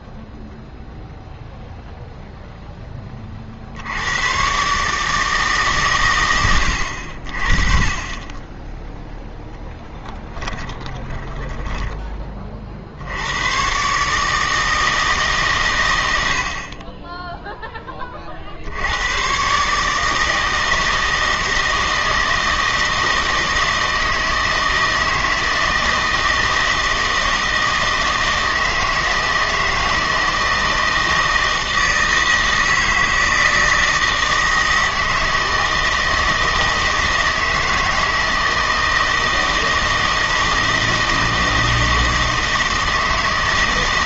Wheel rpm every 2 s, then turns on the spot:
0, 10, 140, 90, 10, 10, 50, 160, 40, 70, 160, 160, 160, 160, 160, 160, 160, 160, 160, 160, 160, 160.
10-12